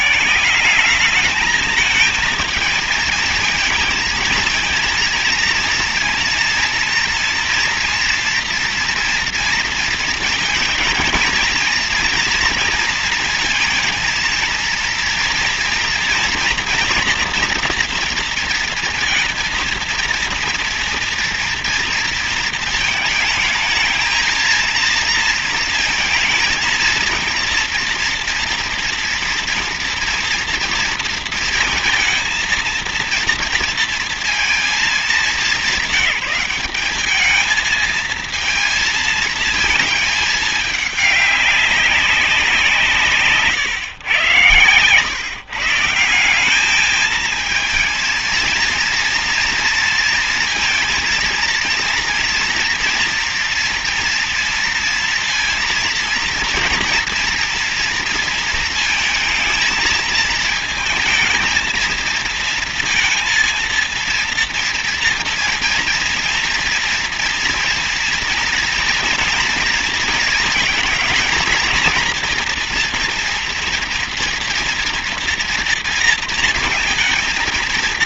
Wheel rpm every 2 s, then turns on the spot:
180, 220, 220, 230, 230, 230, 230, 230, 230, 230, 230, 230, 230, 230, 230, 230, 230, 220, 200, 230, 210, 180, 110, 190, 230, 230, 240, 230, 230, 230, 220, 230, 230, 230, 240, 230, 230, 230, 230.
none